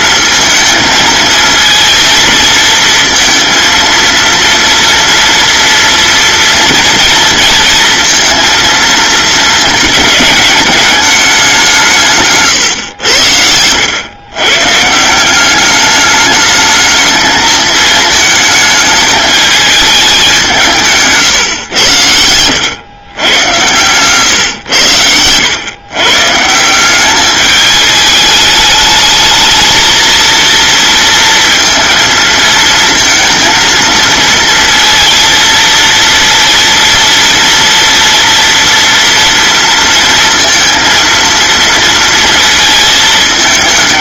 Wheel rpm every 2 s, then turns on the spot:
230, 230, 230, 230, 230, 210, 140, 140, 220, 220, 170, 100, 120, 170, 210, 230, 230, 230, 230, 230, 230, 220.
none